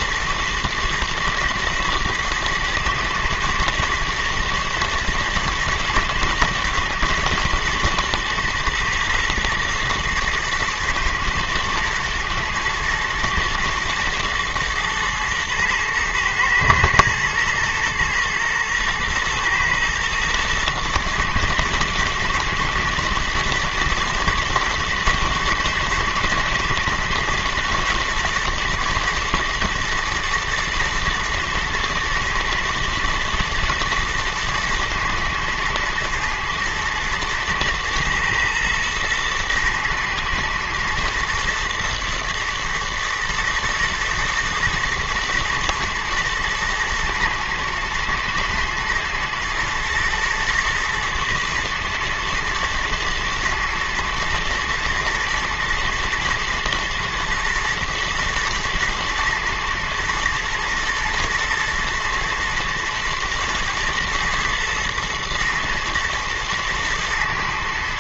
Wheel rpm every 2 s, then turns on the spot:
110, 110, 110, 110, 110, 110, 110, 120, 110, 120, 110, 110, 120, 120, 120, 110, 110, 110, 110, 110, 110, 110, 110, 110, 110, 120, 120, 110, 120, 110, 120, 120, 110, 110.
none